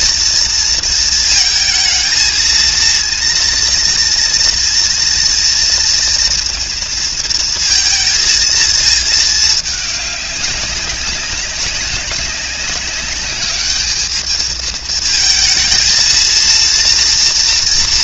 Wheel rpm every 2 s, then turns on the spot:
230, 230, 240, 230, 220, 200, 200, 220, 230.
none